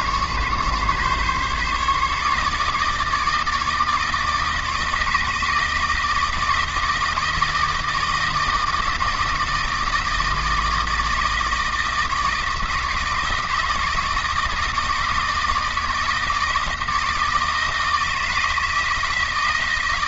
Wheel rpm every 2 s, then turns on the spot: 140, 150, 160, 160, 160, 160, 160, 160, 160, 160.
none